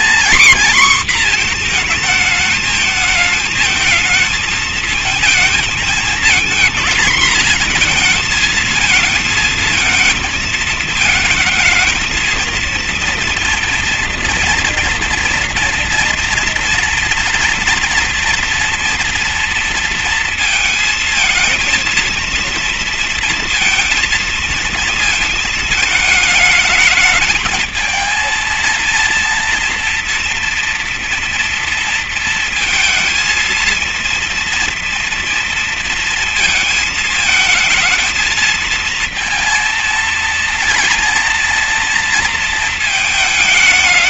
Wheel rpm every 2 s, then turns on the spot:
240, 220, 220, 230, 230, 220, 230, 230, 230, 230, 220, 230, 230, 220, 230, 230, 230, 230, 230, 220, 230, 220.
none